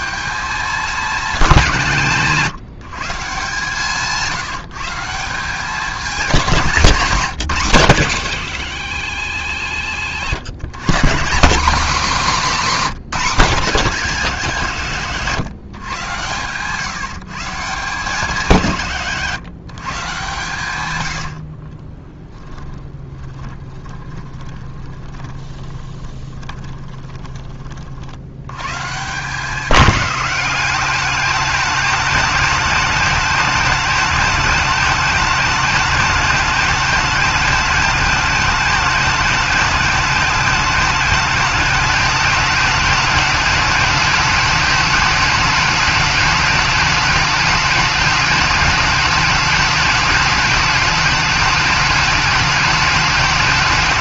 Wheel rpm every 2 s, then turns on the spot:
210, 160, 170, 190, 120, 150, 240, 140, 140, 170, 120, 20, 20, 20, 130, 200, 210, 210, 210, 210, 210, 210, 210, 210, 210, 210, 210.
20-28